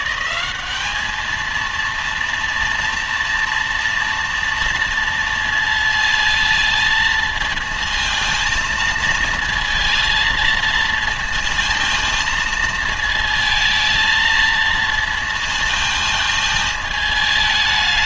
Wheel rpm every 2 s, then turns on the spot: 210, 230, 230, 230, 230, 230, 220, 230, 220.
none